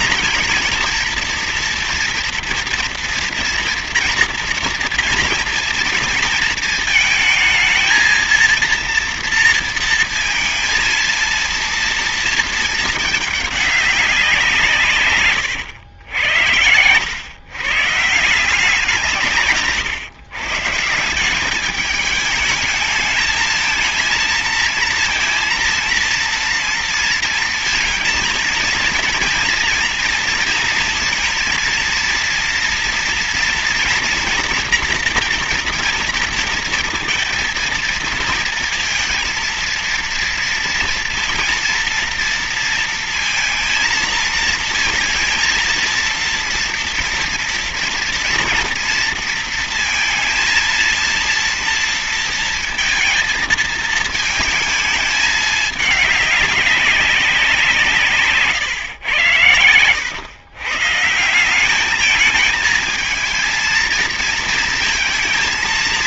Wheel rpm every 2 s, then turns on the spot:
230, 230, 230, 230, 230, 230, 230, 160, 100, 180, 160, 210, 230, 230, 230, 230, 230, 230, 230, 230, 230, 230, 220, 230, 230, 230, 230, 220, 200, 130, 130, 220, 230.
none